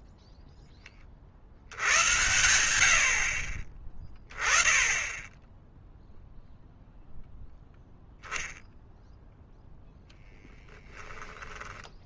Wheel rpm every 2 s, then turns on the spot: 10, 90, 10, 0, 0, 10.
10-12